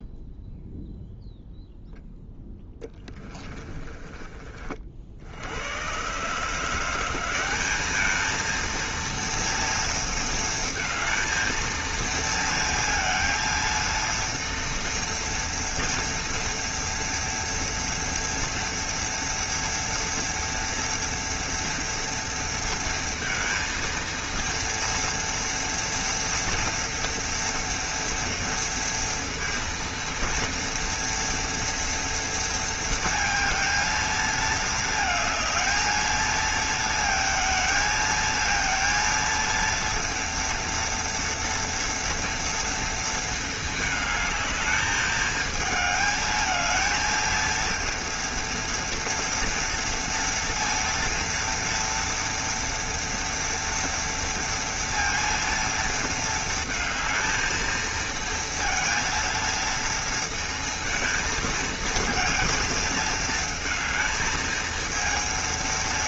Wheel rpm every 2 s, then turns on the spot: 0, 20, 50, 170, 230, 230, 230, 230, 230, 240, 230, 230, 240, 230, 230, 230, 230, 220, 230, 230, 230, 230, 220, 220, 230, 230, 230, 230, 220, 230, 230, 220, 220.
2-4